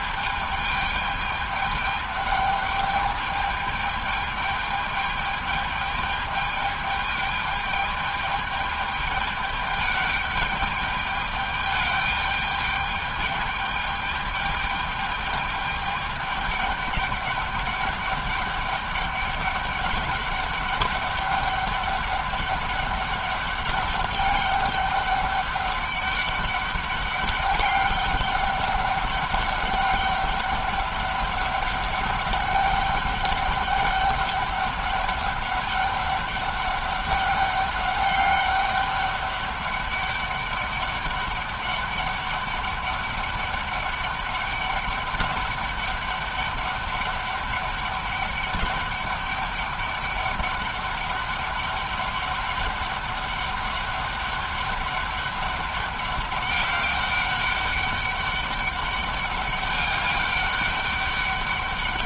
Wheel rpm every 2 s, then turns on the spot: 210, 210, 210, 210, 210, 210, 210, 210, 200, 200, 200, 200, 200, 200, 200, 200, 200, 200, 200, 200, 200, 200, 200, 200, 200, 200, 200, 200, 200, 200, 200.
none